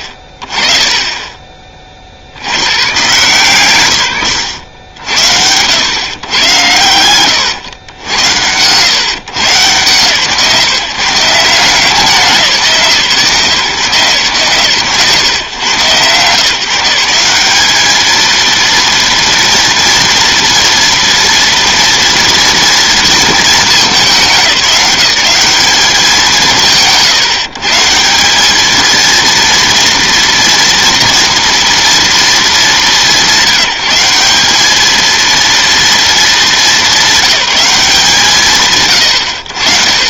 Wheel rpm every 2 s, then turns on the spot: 30, 120, 100, 90, 110, 130, 170, 130, 150, 230, 230, 230, 180, 160, 210, 230, 200, 200, 220, 120.
none